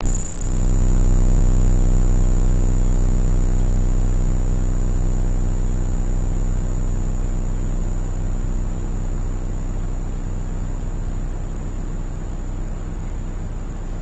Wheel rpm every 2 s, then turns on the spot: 0, 0, 0, 0, 0, 0, 0.
none